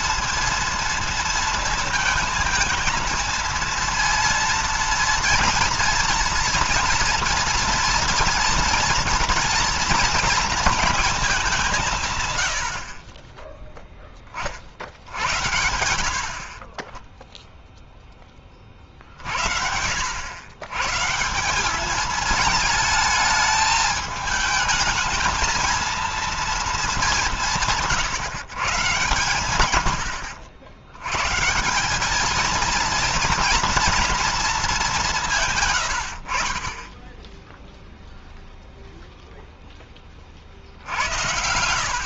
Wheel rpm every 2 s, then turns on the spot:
230, 220, 230, 230, 230, 220, 110, 40, 40, 30, 120, 220, 220, 230, 140, 80, 220, 230, 50, 0, 50.
none